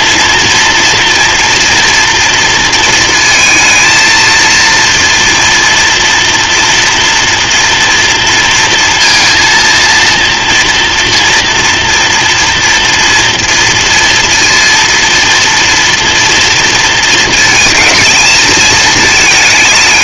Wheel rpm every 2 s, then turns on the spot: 240, 230, 230, 230, 230, 230, 230, 230, 230, 220.
none